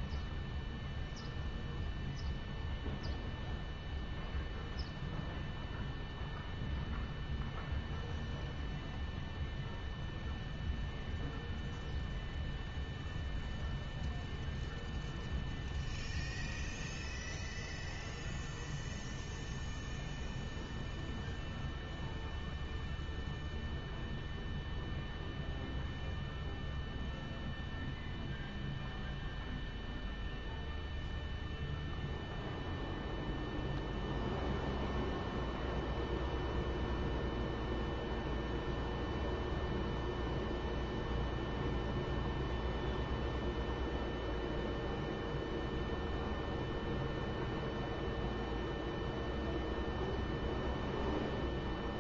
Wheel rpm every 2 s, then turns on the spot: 0, 0, 0, 0, 0, 0, 0, 0, 0, 0, 0, 0, 0, 0, 0, 0, 0, 0, 0, 0, 0, 0, 0, 0, 0, 0.
none